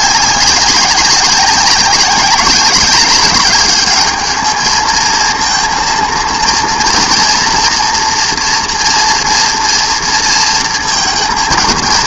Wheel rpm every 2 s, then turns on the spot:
190, 200, 220, 240, 240, 230.
none